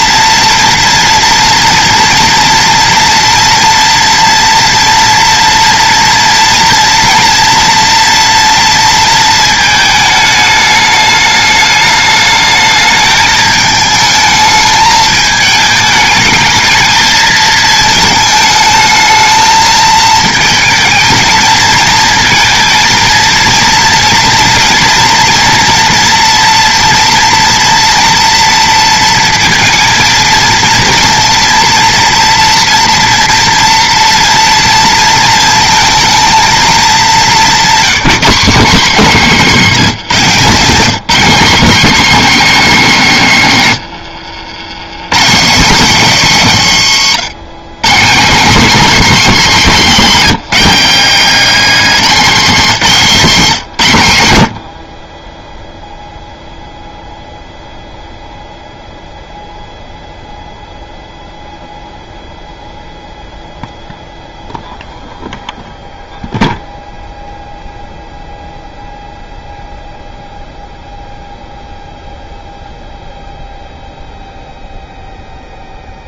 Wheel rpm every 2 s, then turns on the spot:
230, 230, 230, 230, 230, 210, 210, 220, 220, 220, 220, 230, 230, 230, 230, 230, 230, 230, 220, 190, 180, 230, 100, 160, 210, 190, 190, 90, 0, 0, 0, 0, 0, 0, 0, 0, 0, 0.
none